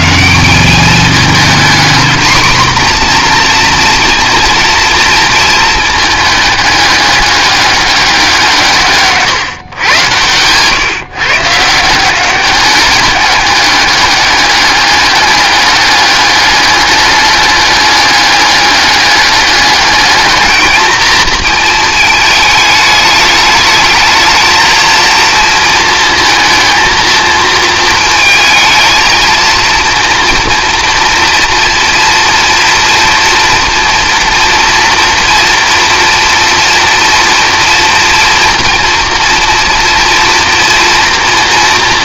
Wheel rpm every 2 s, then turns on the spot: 190, 240, 230, 210, 160, 130, 200, 200, 200, 210, 220, 210, 220, 230, 220, 240, 240, 230, 230, 230, 230.
none